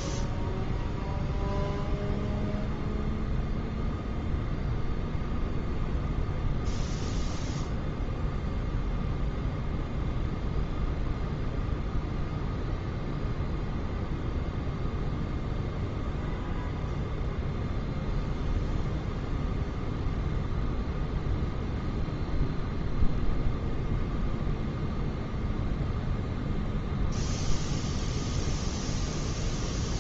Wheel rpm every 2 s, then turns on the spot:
0, 0, 0, 0, 0, 0, 0, 0, 0, 0, 0, 0, 0, 0, 0.
none